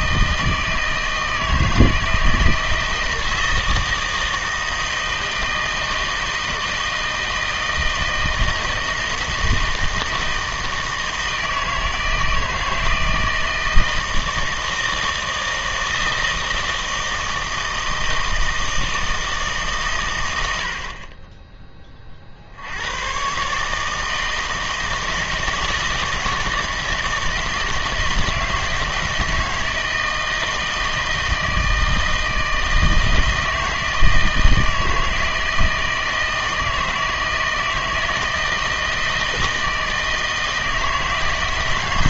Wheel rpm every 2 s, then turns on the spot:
160, 160, 160, 160, 160, 160, 160, 160, 160, 160, 60, 90, 160, 160, 160, 160, 160, 160, 160, 160, 160.
none